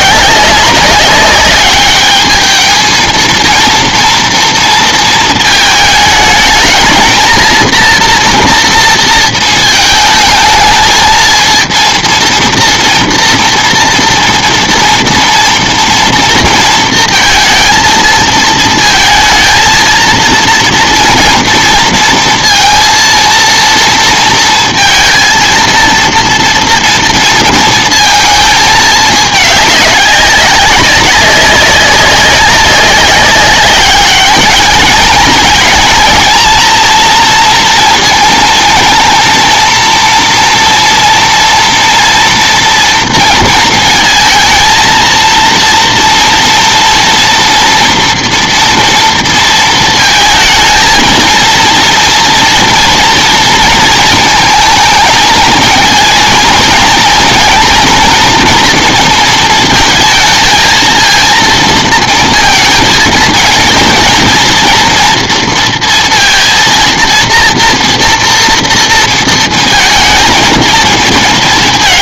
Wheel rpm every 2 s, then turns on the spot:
200, 220, 230, 220, 230, 220, 230, 230, 230, 220, 230, 230, 230, 230, 220, 190, 200, 210, 230, 230, 230, 230, 220, 230, 230, 230, 230, 220, 230, 230, 230, 230, 230, 230, 230, 230.
none